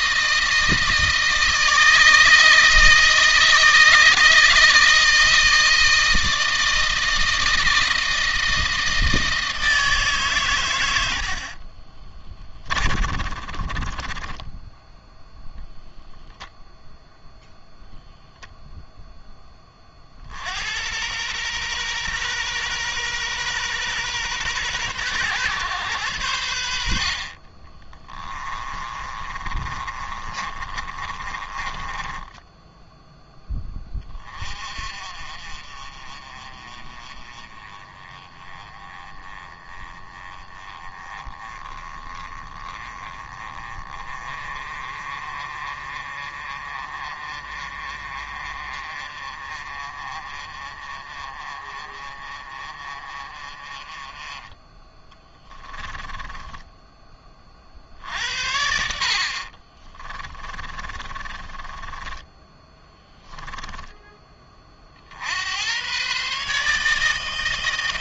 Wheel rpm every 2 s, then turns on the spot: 160, 160, 160, 160, 160, 110, 30, 10, 0, 0, 80, 120, 120, 70, 20, 30, 10, 30, 30, 20, 20, 20, 30, 30, 30, 30, 30, 10, 10, 60, 30, 10, 30, 150.
12-16 28-34 60-64